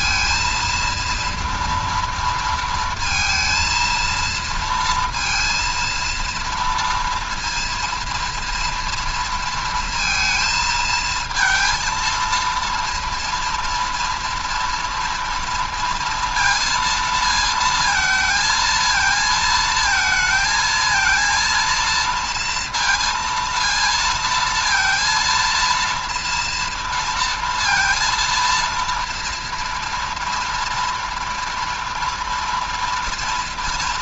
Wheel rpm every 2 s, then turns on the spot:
230, 230, 230, 230, 230, 220, 230, 240, 230, 230, 230, 230, 230, 230, 230, 230, 230.
none